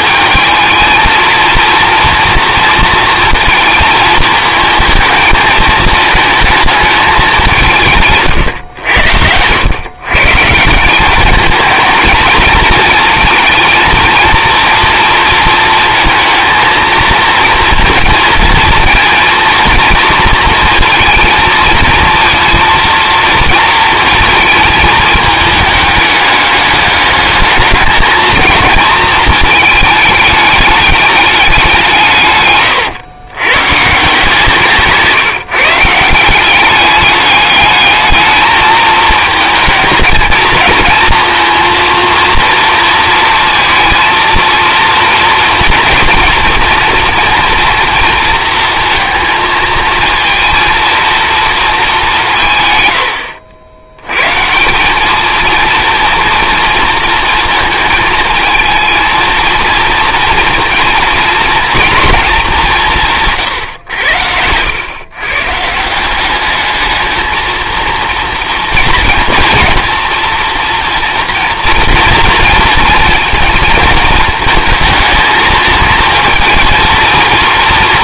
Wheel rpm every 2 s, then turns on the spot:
220, 230, 230, 220, 110, 170, 220, 230, 220, 230, 230, 230, 220, 210, 220, 210, 130, 160, 200, 220, 230, 230, 230, 230, 230, 230, 120, 180, 230, 220, 240, 190, 100, 210, 230, 230, 230, 220, 230.
32-34